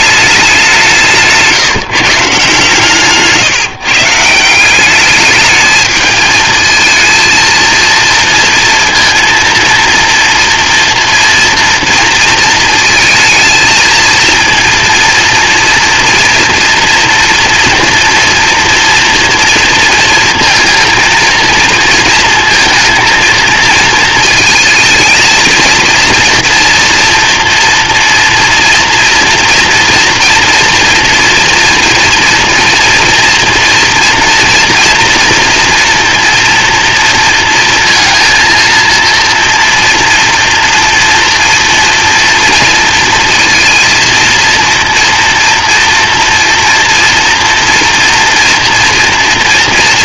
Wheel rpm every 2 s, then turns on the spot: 200, 140, 170, 220, 230, 230, 220, 230, 230, 230, 230, 230, 230, 230, 230, 230, 230, 240, 240, 230, 230, 230, 230, 230, 230.
none